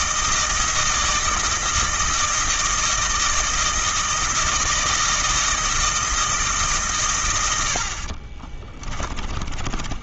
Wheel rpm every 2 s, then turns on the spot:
160, 160, 160, 140, 30.
8-10